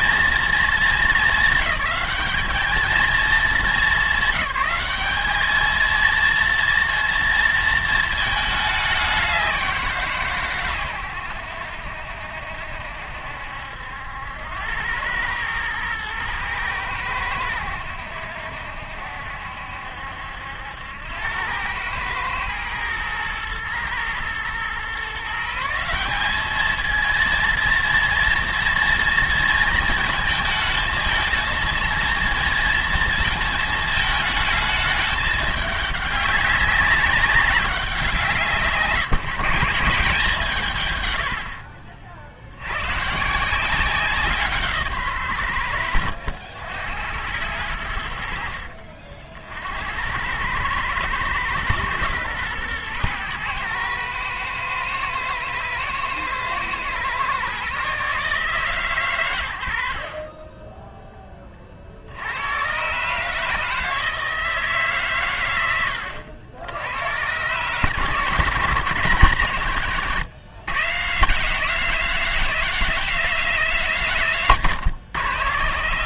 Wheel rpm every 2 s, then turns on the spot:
220, 200, 200, 230, 210, 130, 70, 90, 110, 70, 80, 110, 120, 210, 230, 220, 230, 220, 200, 150, 140, 80, 160, 80, 60, 100, 120, 110, 120, 150, 20, 110, 150, 90, 140, 130, 180, 130.
48-50